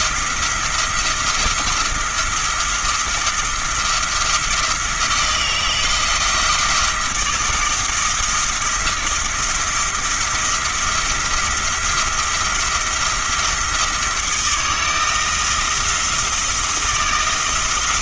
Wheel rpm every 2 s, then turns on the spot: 170, 170, 170, 170, 170, 170, 170, 160, 170.
none